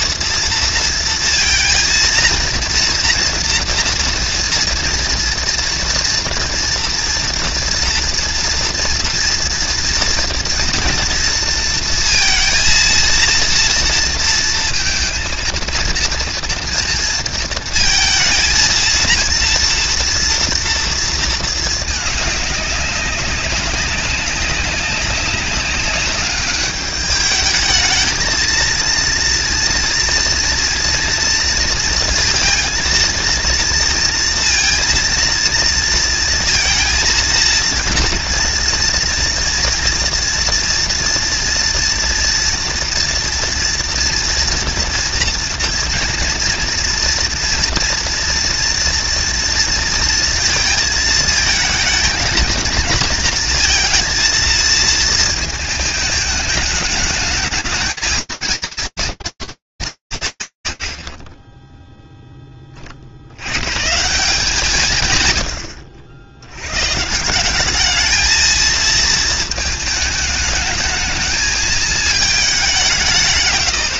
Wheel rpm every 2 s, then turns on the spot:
230, 230, 230, 230, 230, 230, 230, 230, 230, 230, 230, 200, 190, 210, 230, 230, 230, 230, 230, 230, 230, 230, 230, 230, 230, 230, 230, 220, 220, 230, 90, 40, 140, 140, 220, 220, 170.
none